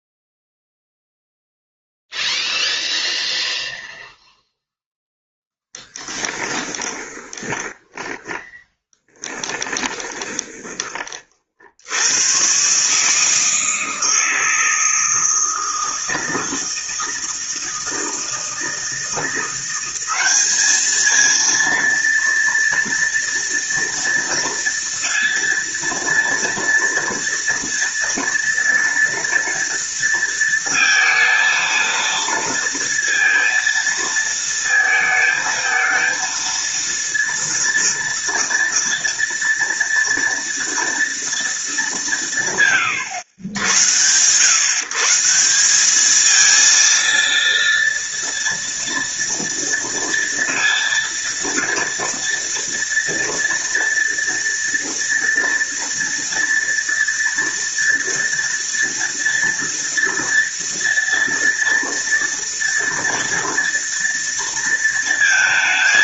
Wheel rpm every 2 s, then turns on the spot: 0, 0, 10, 20, 10, 20, 140, 160, 160, 160, 210, 230, 230, 230, 230, 230, 230, 220, 230, 230, 230, 140, 140, 230, 230, 230, 230, 230, 230, 230, 230, 230, 230.
6-10